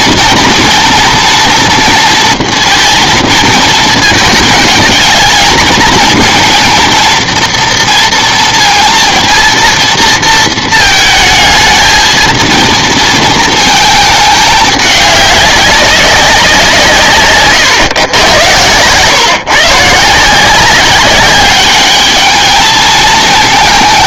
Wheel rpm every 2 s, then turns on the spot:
240, 230, 220, 230, 230, 220, 230, 210, 180, 110, 180, 220.
none